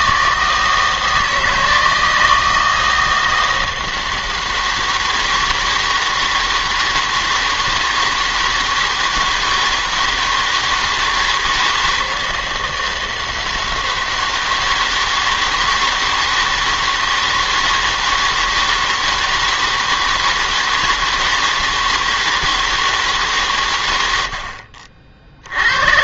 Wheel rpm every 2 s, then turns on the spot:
160, 160, 160, 160, 160, 160, 160, 160, 160, 160, 160, 160, 60.
none